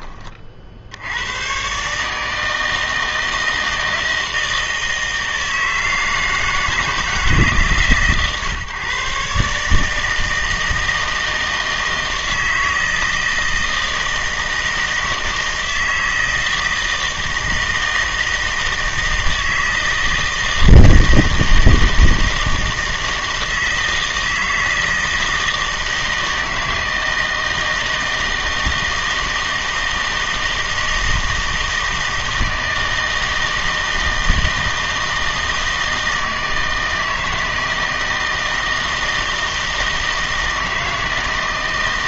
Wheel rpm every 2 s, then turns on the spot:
60, 160, 160, 160, 130, 160, 160, 160, 160, 160, 160, 160, 160, 160, 160, 160, 160, 160, 160, 160, 160.
none